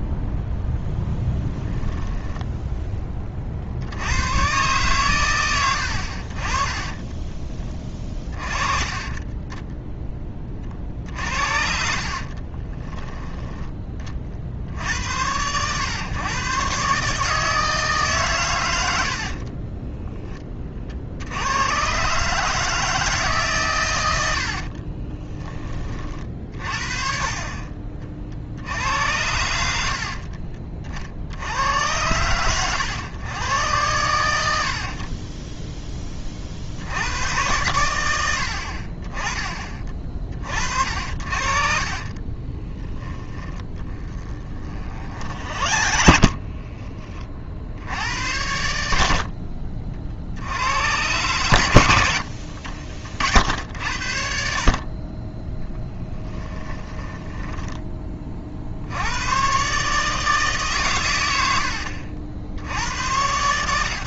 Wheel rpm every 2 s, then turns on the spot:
10, 10, 120, 30, 40, 40, 20, 80, 140, 60, 60, 160, 40, 40, 80, 40, 100, 30, 70, 50, 60, 10, 40, 30, 90, 100, 60, 40, 10, 60, 130, 90.
0-2 12-14 24-26 42-46 56-58